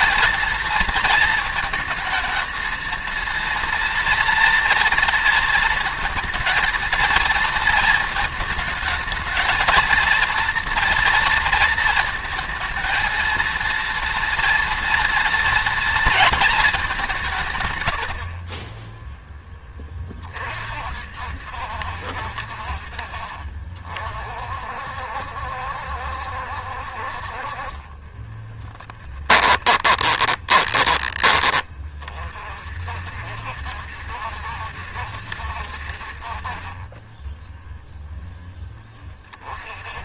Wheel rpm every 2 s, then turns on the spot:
220, 220, 230, 230, 220, 230, 230, 230, 220, 30, 40, 60, 50, 70, 20, 20, 40, 70, 30, 10.
28-32